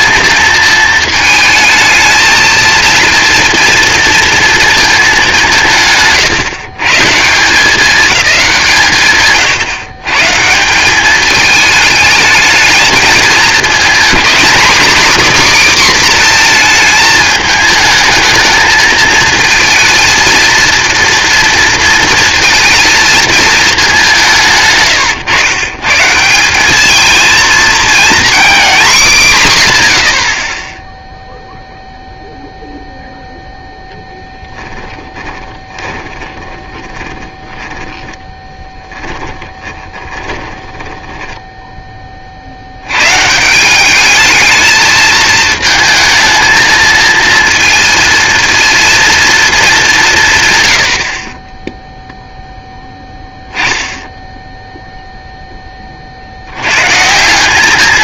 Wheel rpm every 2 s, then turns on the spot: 220, 230, 230, 140, 170, 190, 220, 260, 230, 220, 230, 220, 150, 200, 240, 30, 0, 10, 10, 10, 10, 80, 220, 220, 230, 110, 0, 0, 100.
34-42